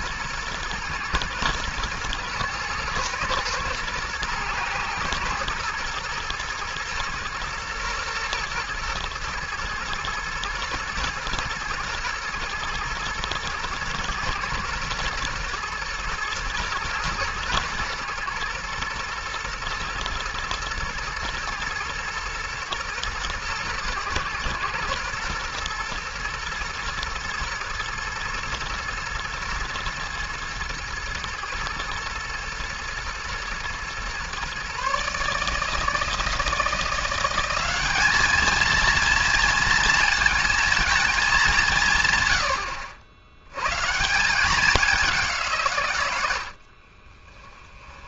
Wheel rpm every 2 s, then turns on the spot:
120, 120, 110, 110, 110, 120, 110, 120, 120, 110, 110, 110, 120, 110, 120, 110, 110, 140, 170, 230, 220, 80, 200, 50.
46-48